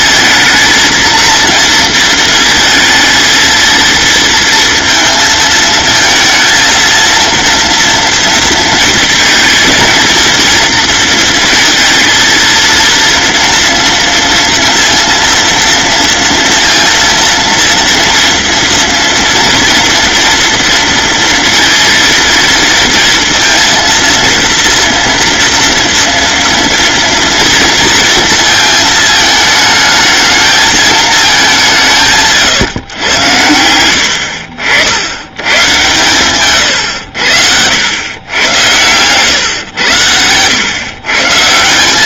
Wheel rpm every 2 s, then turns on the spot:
230, 230, 230, 230, 230, 230, 230, 230, 230, 240, 230, 230, 240, 230, 220, 220, 130, 80, 100, 110, 130.
36-38